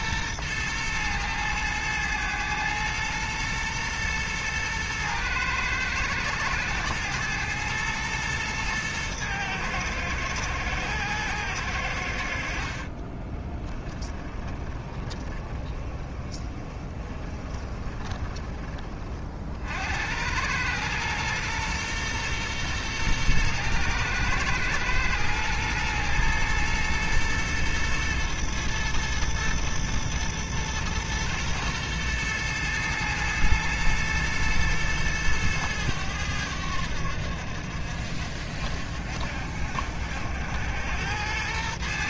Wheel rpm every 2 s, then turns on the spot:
110, 110, 110, 110, 110, 110, 50, 20, 20, 20, 110, 120, 110, 120, 110, 120, 120, 110, 90, 60, 90.
14-18